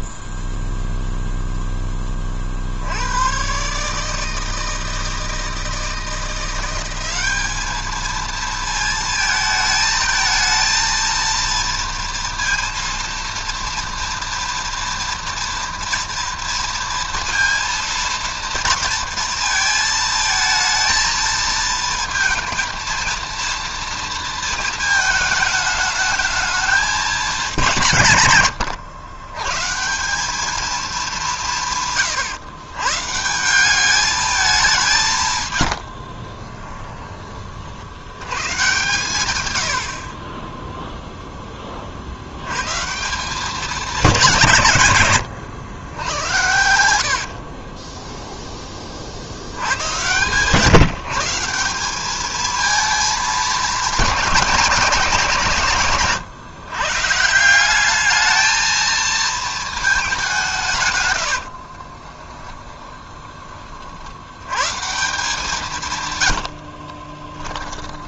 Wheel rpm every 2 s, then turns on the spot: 0, 40, 160, 180, 230, 220, 230, 230, 230, 230, 220, 230, 220, 210, 120, 200, 130, 210, 40, 110, 20, 90, 170, 80, 10, 140, 220, 200, 130, 220, 180, 20, 100, 80.
36-38 40-42 62-64 66-68